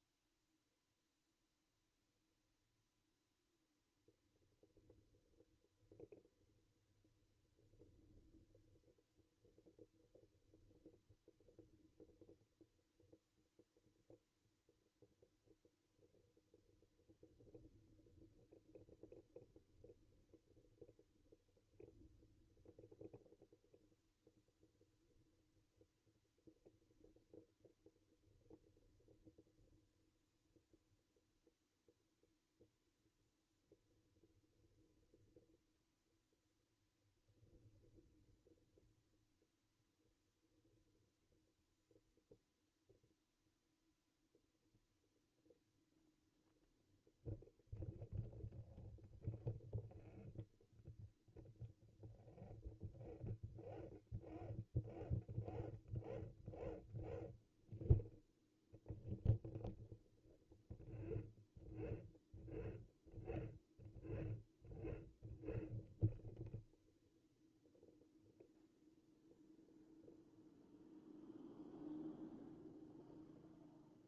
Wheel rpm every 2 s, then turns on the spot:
0, 0, 0, 0, 0, 0, 0, 0, 0, 0, 0, 0, 0, 0, 0, 0, 0, 0, 0, 0, 0, 0, 0, 0, 0, 0, 0, 0, 0, 0, 0, 0, 0, 0, 0, 0, 0.
none